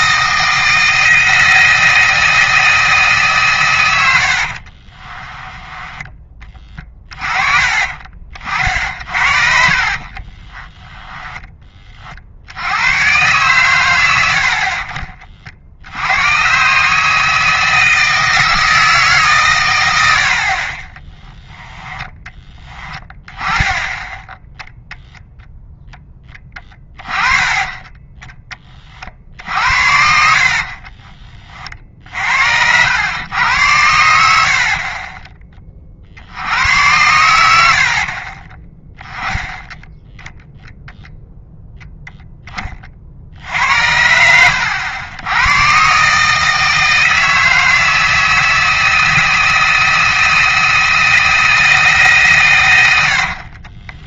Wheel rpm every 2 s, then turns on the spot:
160, 160, 50, 20, 50, 20, 90, 50, 130, 160, 20, 20, 10, 20, 30, 50, 80, 50, 90, 30, 0, 20, 90, 160, 160, 160, 110.
4-6 8-12 20-22 30-32 34-36